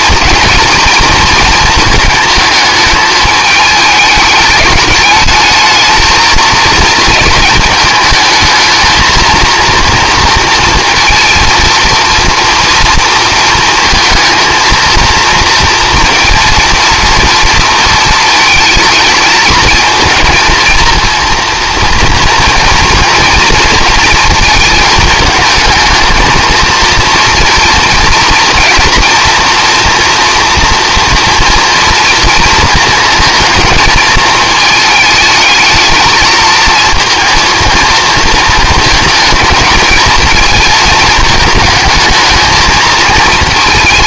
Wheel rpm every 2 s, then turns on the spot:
220, 220, 210, 230, 220, 230, 230, 230, 230, 220, 220, 230, 220, 230, 230, 240, 230, 220, 230, 230, 220, 220.
none